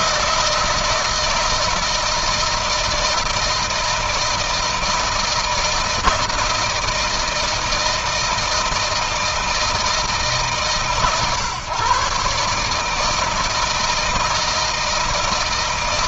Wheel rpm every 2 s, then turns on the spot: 160, 160, 160, 160, 160, 140, 150, 160.
none